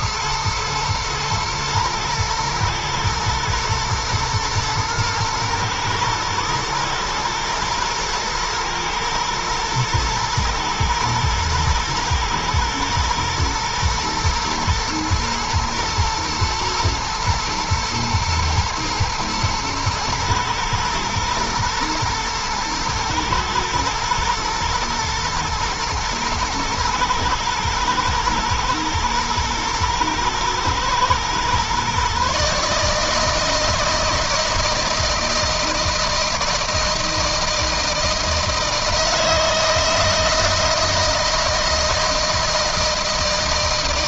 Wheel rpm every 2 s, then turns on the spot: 110, 110, 120, 110, 110, 110, 110, 110, 120, 120, 110, 120, 120, 110, 110, 110, 150, 160, 160, 160, 160, 160.
none